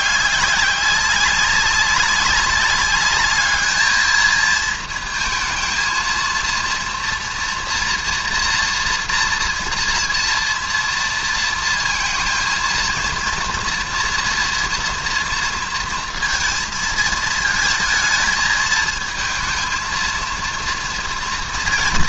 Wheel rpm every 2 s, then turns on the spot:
200, 190, 230, 230, 230, 230, 220, 230, 220, 220, 230.
none